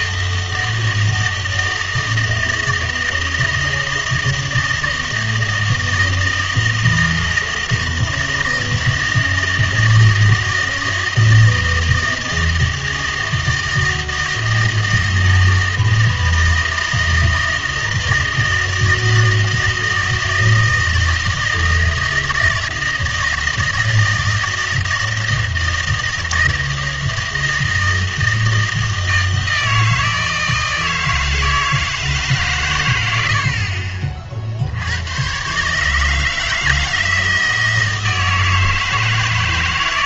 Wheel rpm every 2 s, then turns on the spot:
160, 160, 160, 160, 160, 160, 160, 160, 160, 160, 160, 160, 160, 160, 160, 160, 110, 70, 160, 160.
none